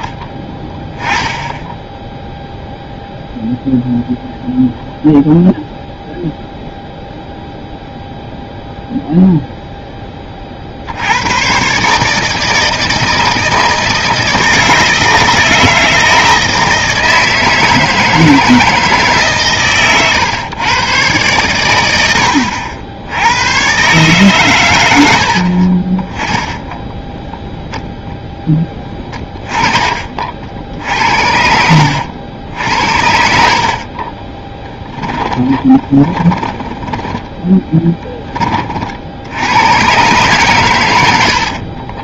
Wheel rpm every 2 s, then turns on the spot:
10, 0, 0, 0, 0, 60, 160, 160, 160, 160, 120, 80, 110, 10, 10, 60, 60, 10, 10, 40, 110.
26-28 34-38